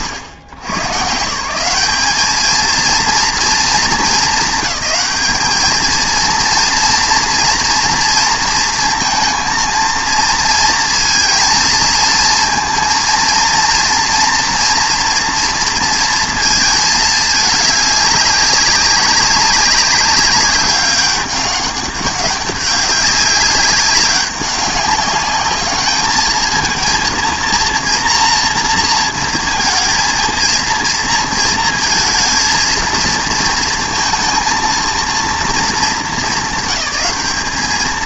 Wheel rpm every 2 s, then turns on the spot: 120, 230, 210, 230, 230, 230, 230, 230, 220, 190, 200, 200, 200, 220, 230, 230, 230, 230, 200.
none